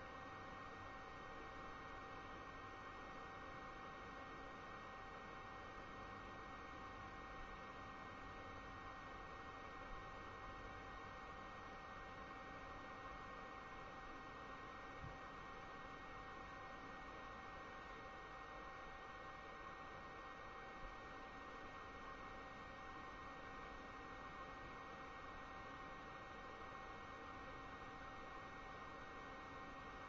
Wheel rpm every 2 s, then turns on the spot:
0, 0, 0, 0, 0, 0, 0, 0, 0, 0, 0, 0, 0, 0, 0.
none